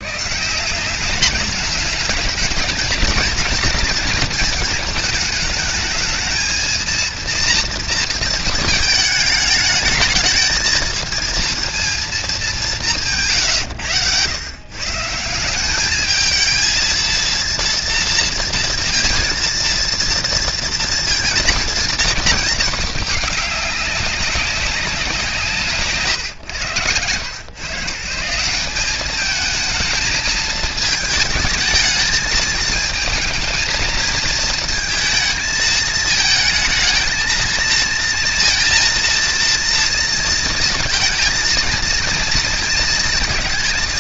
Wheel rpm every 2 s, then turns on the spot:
160, 220, 220, 220, 220, 220, 210, 130, 220, 230, 230, 220, 200, 130, 180, 220, 220, 230, 220, 230, 230, 230.
none